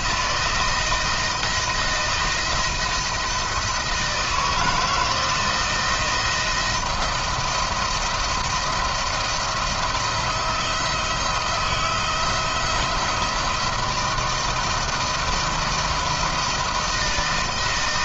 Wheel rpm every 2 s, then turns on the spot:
160, 160, 160, 170, 170, 160, 170, 160, 160.
none